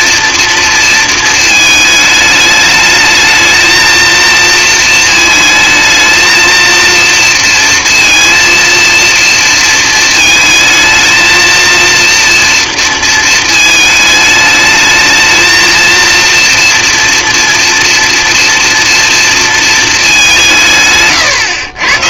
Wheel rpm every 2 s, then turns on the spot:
230, 210, 230, 230, 230, 220, 230, 220, 230, 230, 150.
none